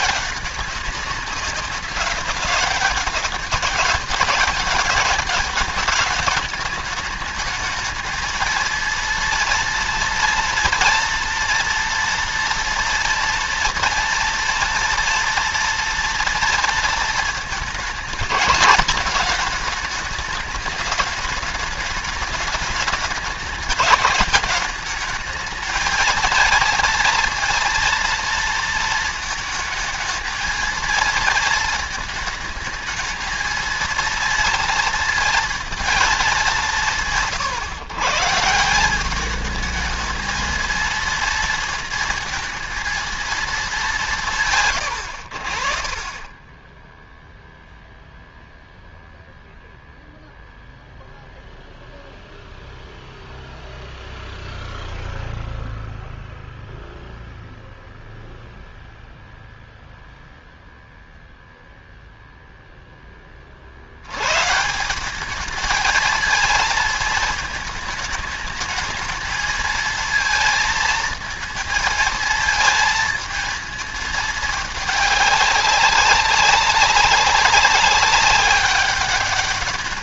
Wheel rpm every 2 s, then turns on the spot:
200, 200, 200, 210, 230, 230, 230, 230, 230, 220, 210, 210, 210, 230, 220, 230, 220, 230, 180, 180, 230, 230, 120, 10, 0, 0, 0, 0, 0, 0, 0, 0, 160, 230, 220, 220, 220, 210, 190, 200.
46-48